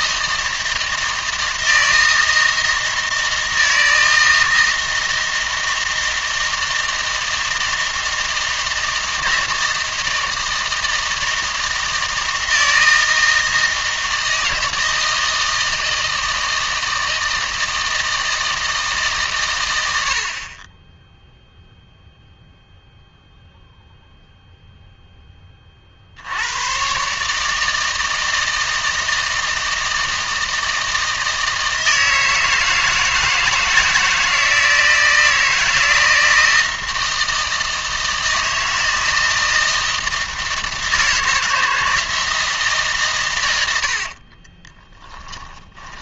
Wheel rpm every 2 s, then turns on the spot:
160, 160, 160, 160, 160, 160, 160, 160, 160, 160, 20, 0, 0, 120, 160, 160, 160, 160, 160, 160, 160, 150, 20.
44-46